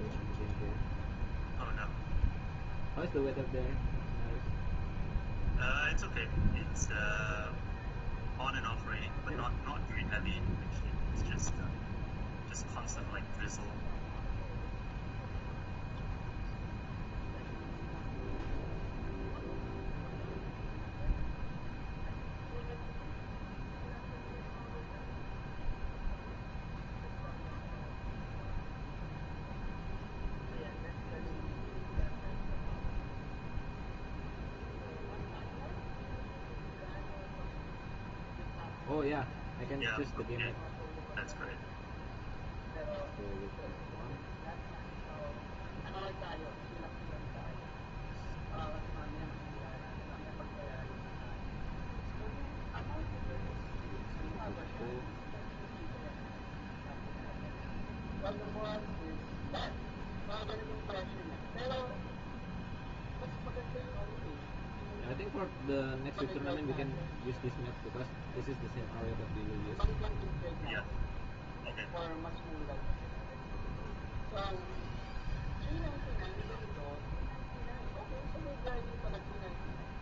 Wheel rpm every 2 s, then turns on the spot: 0, 0, 0, 0, 0, 0, 0, 0, 0, 0, 0, 0, 0, 0, 0, 0, 0, 0, 0, 0, 0, 0, 0, 0, 0, 0, 0, 0, 0, 0, 0, 0, 0, 0, 0, 0, 0, 0, 0, 0.
none